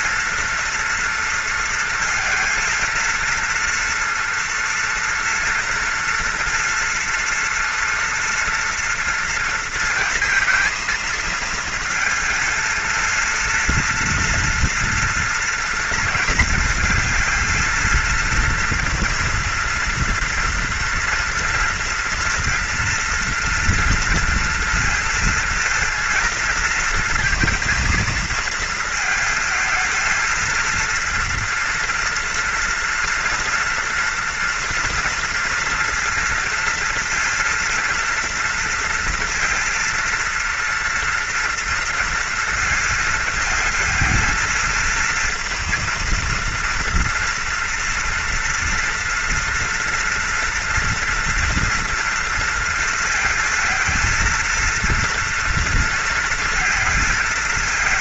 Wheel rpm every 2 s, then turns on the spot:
230, 230, 230, 230, 240, 230, 230, 230, 230, 230, 230, 230, 230, 230, 220, 220, 240, 230, 230, 230, 230, 230, 230, 230, 230, 230, 230, 230, 230.
none